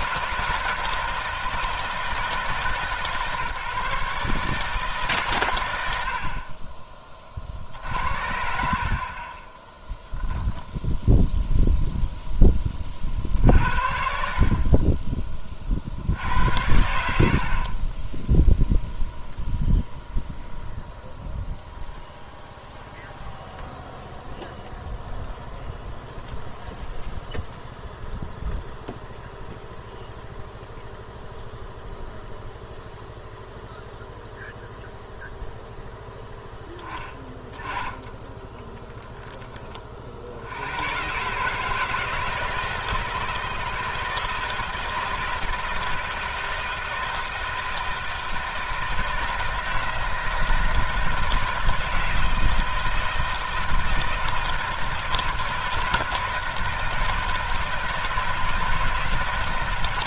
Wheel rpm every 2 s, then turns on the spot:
170, 160, 150, 60, 60, 0, 0, 50, 80, 10, 0, 0, 0, 0, 0, 0, 0, 0, 10, 10, 60, 160, 160, 160, 160, 160, 160, 160, 160, 160.
none